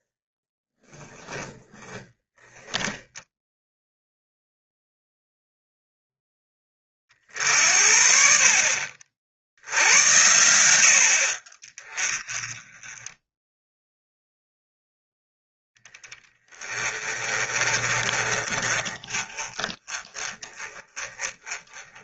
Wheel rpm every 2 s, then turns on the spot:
10, 10, 0, 20, 50, 80, 20, 10, 20, 20, 20.
0-4